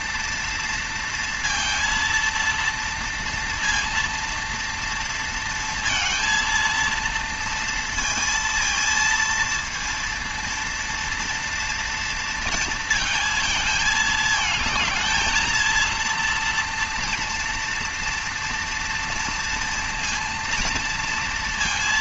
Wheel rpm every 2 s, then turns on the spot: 230, 230, 230, 230, 230, 230, 230, 220, 230, 230, 230.
none